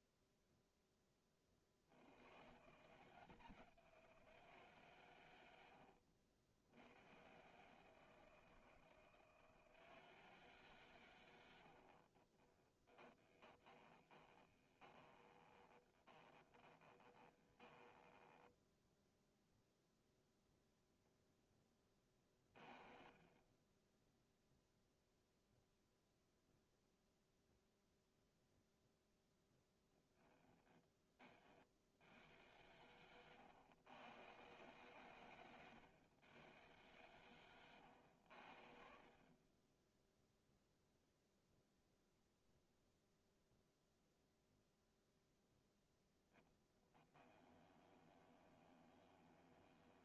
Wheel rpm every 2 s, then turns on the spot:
0, 150, 150, 80, 160, 140, 20, 20, 20, 10, 0, 30, 0, 0, 0, 10, 90, 120, 110, 60, 0, 0, 0, 10, 20.
12-18 46-50